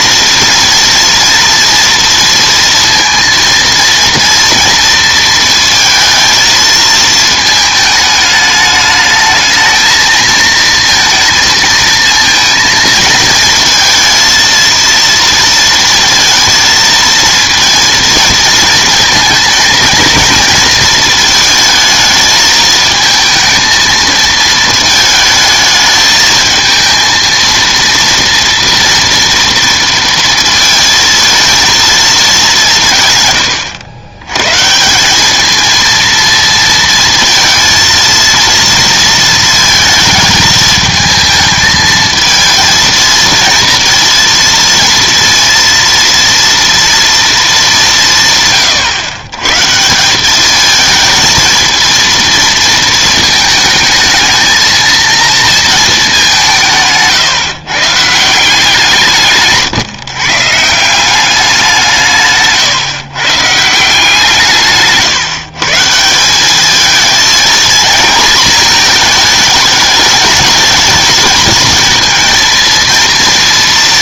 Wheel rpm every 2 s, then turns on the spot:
240, 230, 230, 220, 210, 230, 230, 230, 230, 230, 230, 220, 220, 220, 230, 230, 190, 130, 230, 230, 220, 230, 230, 230, 130, 210, 230, 220, 170, 160, 150, 140, 160, 190, 230, 220, 230.
none